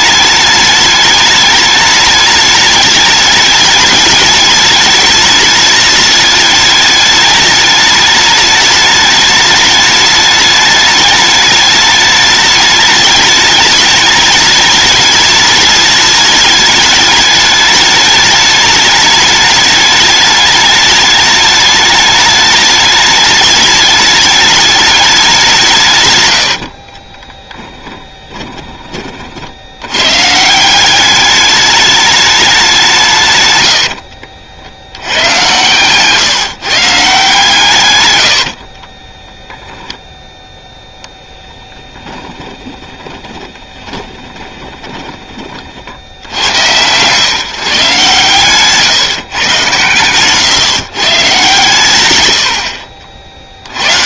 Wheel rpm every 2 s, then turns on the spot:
210, 210, 210, 210, 210, 210, 210, 210, 210, 210, 210, 210, 210, 60, 10, 180, 190, 80, 150, 50, 0, 20, 20, 100, 140, 140, 80.
26-28 38-40 42-46